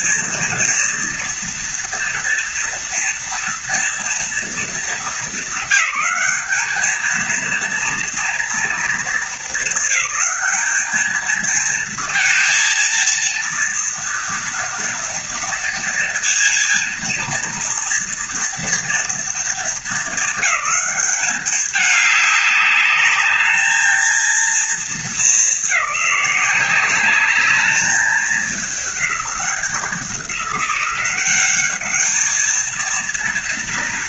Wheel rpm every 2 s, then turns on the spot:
240, 230, 220, 220, 230, 220, 230, 230, 230, 230, 200, 200, 220, 200, 210, 190, 230.
none